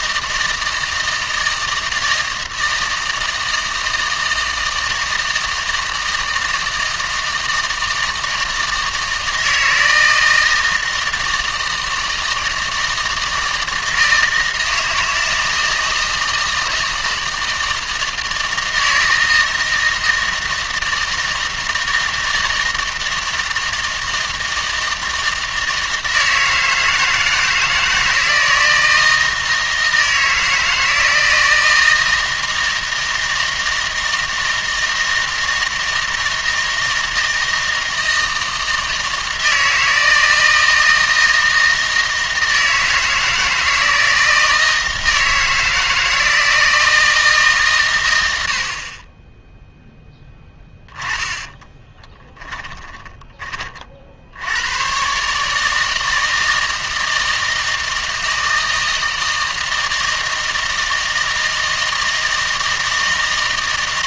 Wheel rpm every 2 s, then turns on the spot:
160, 160, 160, 160, 160, 160, 160, 160, 160, 160, 160, 160, 160, 160, 160, 160, 160, 160, 160, 160, 160, 160, 160, 160, 50, 10, 10, 120, 160, 160, 160, 160.
52-54